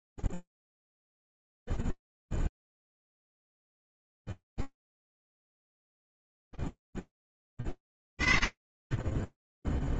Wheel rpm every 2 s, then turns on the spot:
0, 0, 0, 20, 0.
none